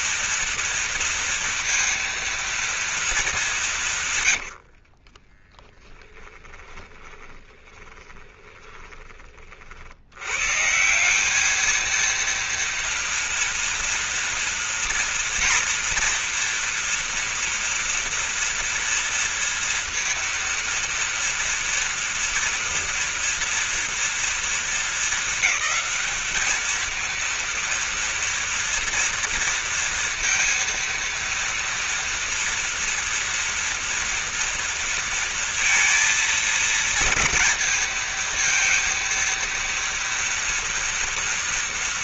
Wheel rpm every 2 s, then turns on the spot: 230, 230, 60, 10, 20, 170, 230, 240, 230, 240, 230, 240, 220, 220, 230, 230, 230, 230, 230, 230, 230.
4-10